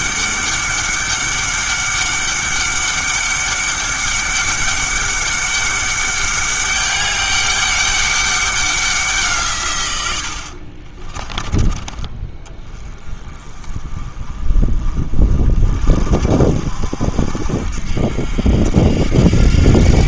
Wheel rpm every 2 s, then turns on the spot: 200, 200, 200, 200, 190, 50, 20, 40, 60, 70.
10-12